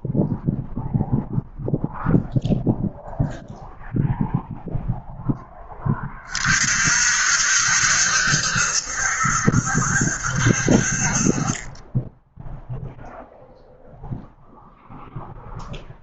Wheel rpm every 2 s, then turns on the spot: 0, 0, 0, 50, 70, 50, 0, 0.
none